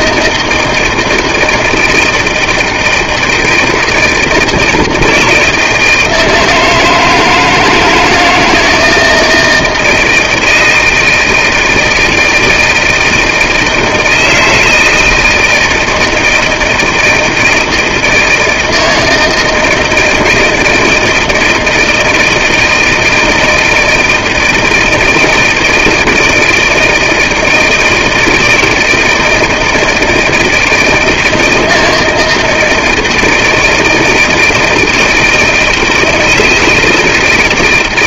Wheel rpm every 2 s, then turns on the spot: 160, 160, 160, 160, 160, 160, 160, 160, 160, 160, 160, 160, 170, 160, 160, 160, 160, 160, 160.
none